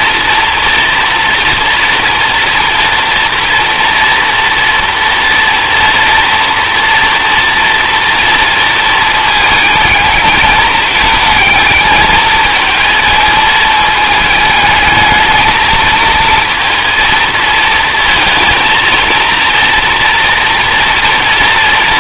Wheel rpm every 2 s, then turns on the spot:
230, 230, 230, 230, 230, 220, 220, 220, 220, 220, 240.
none